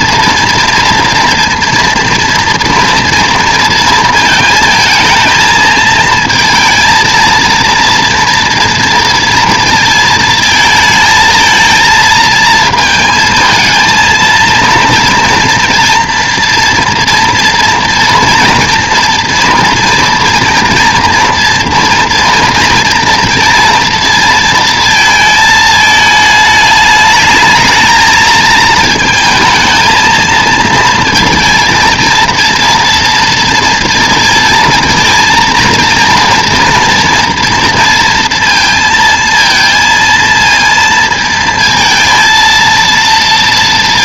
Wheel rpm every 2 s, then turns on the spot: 230, 230, 220, 220, 230, 220, 220, 230, 240, 240, 240, 230, 230, 210, 230, 230, 230, 230, 230, 230, 230, 230.
none